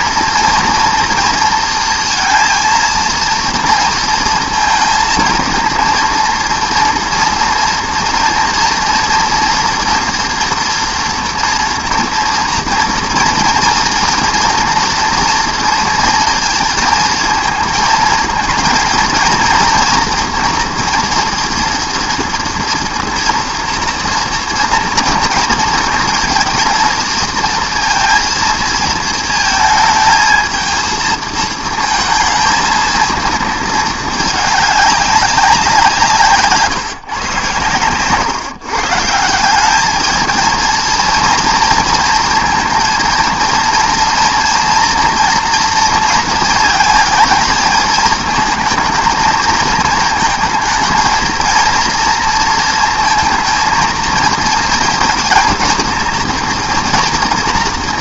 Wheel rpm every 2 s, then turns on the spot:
240, 230, 230, 230, 240, 230, 230, 230, 230, 230, 230, 230, 230, 220, 230, 220, 220, 210, 150, 150, 230, 230, 230, 230, 230, 230, 230, 230, 230.
none